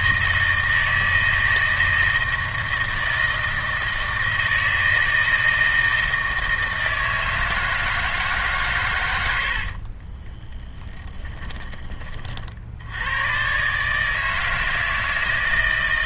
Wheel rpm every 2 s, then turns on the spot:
160, 160, 160, 160, 140, 20, 60, 160.
10-12